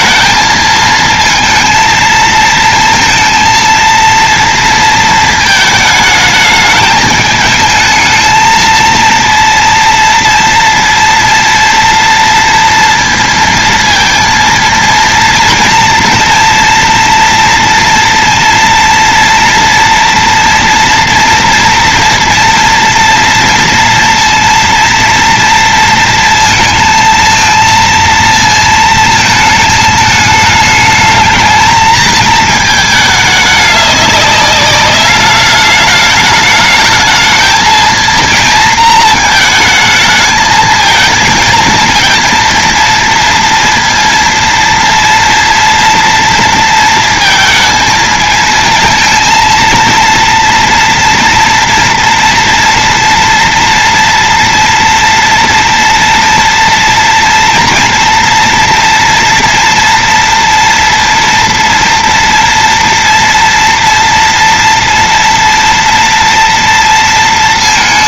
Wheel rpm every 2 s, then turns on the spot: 220, 230, 230, 210, 230, 230, 230, 230, 230, 230, 230, 230, 230, 230, 220, 220, 220, 200, 220, 220, 220, 230, 230, 230, 230, 230, 230, 230, 230, 230, 230, 230, 230, 230.
none